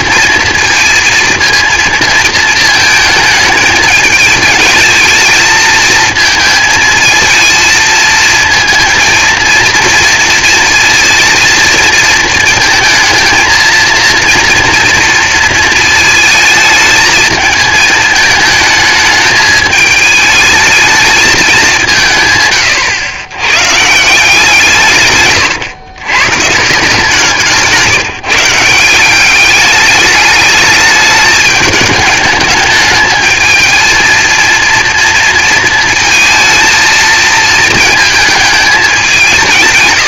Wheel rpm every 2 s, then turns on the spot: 230, 220, 220, 230, 230, 230, 230, 230, 220, 220, 220, 110, 160, 150, 170, 210, 210, 240, 230, 210.
none